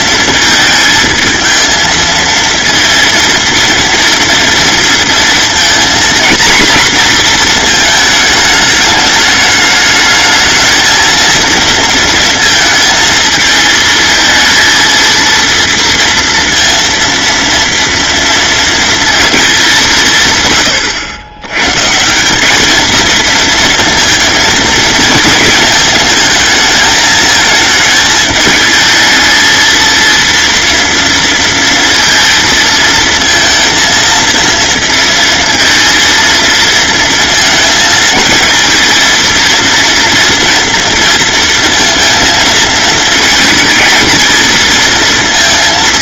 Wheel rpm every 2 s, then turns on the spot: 220, 230, 230, 240, 210, 220, 220, 230, 230, 230, 100, 220, 220, 220, 220, 230, 230, 230, 220, 230, 230, 230, 230.
none